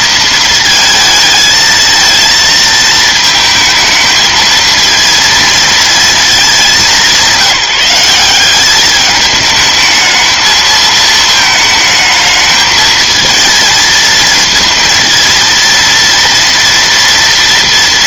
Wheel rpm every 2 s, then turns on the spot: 220, 230, 220, 220, 190, 220, 220, 230, 230.
none